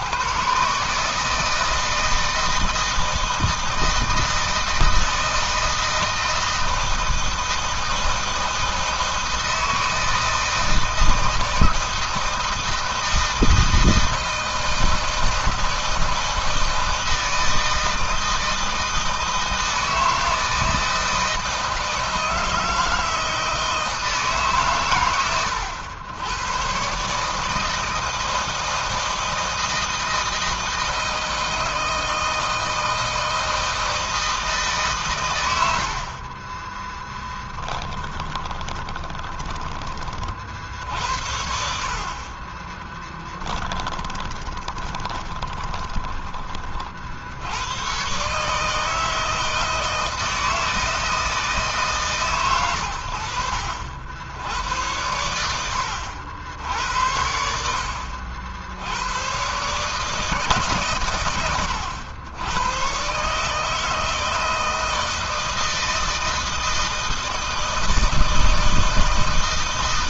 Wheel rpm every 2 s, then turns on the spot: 150, 160, 160, 160, 160, 160, 160, 160, 160, 160, 160, 160, 140, 110, 160, 160, 160, 150, 30, 10, 50, 30, 30, 30, 140, 160, 130, 90, 80, 80, 150, 110, 160, 160, 160.
38-40 42-46